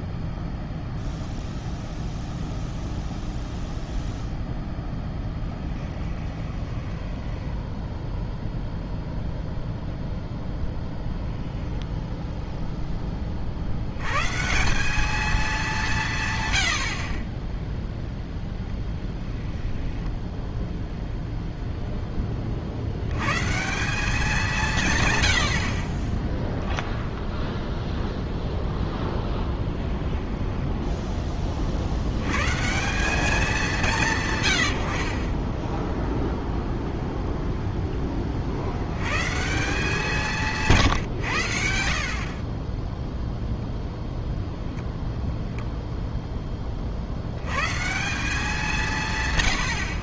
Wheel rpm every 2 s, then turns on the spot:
0, 0, 0, 10, 0, 0, 0, 160, 100, 0, 0, 50, 180, 10, 0, 10, 140, 100, 0, 50, 160, 20, 10, 20, 180.
6-8 30-32